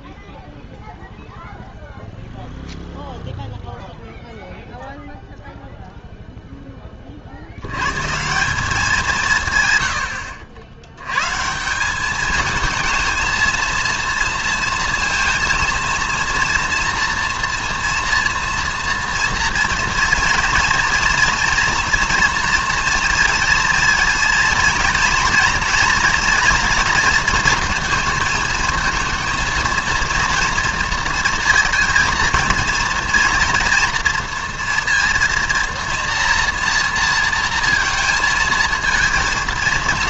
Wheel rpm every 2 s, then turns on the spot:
0, 0, 0, 10, 190, 90, 220, 230, 240, 230, 230, 240, 230, 230, 220, 230, 220, 230, 230, 230.
none